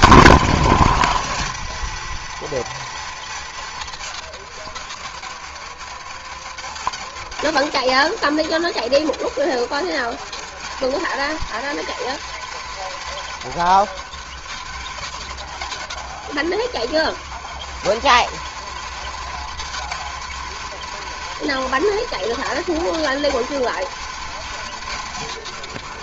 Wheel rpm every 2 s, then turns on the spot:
180, 220, 190, 170, 170, 190, 230, 180, 180, 220, 220, 220, 220.
none